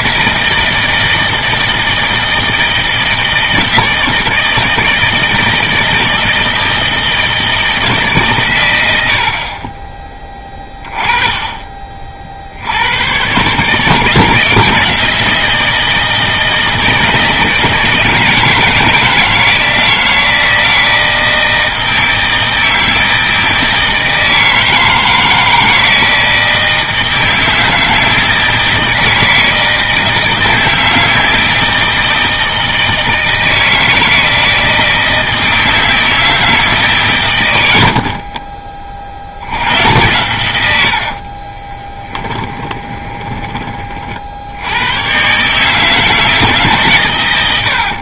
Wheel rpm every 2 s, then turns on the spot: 160, 160, 160, 160, 110, 20, 70, 160, 170, 160, 160, 160, 160, 160, 160, 160, 160, 160, 160, 40, 100, 30, 70, 150.
38-40 42-44